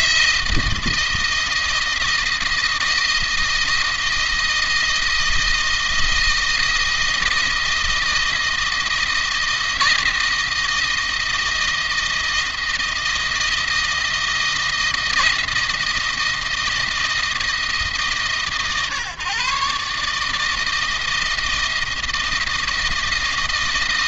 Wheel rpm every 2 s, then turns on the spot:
170, 170, 160, 160, 170, 170, 160, 170, 170, 130, 160, 160.
none